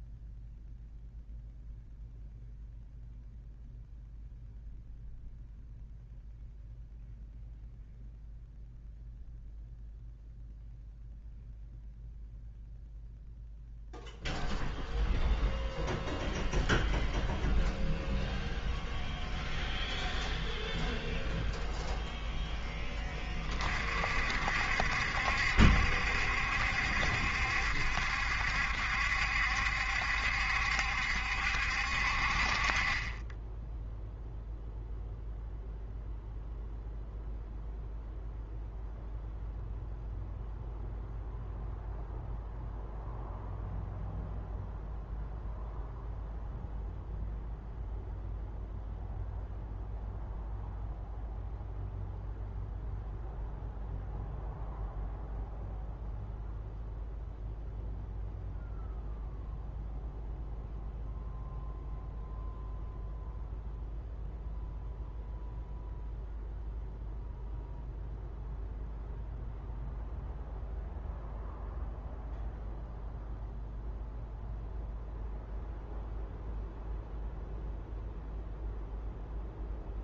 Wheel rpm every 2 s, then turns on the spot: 0, 0, 0, 0, 0, 0, 0, 0, 0, 0, 0, 10, 60, 70, 70, 70, 40, 0, 0, 0, 0, 0, 0, 0, 0, 0, 0, 0, 0, 0, 0, 0, 0, 0, 0, 0, 0, 0, 0, 0.
none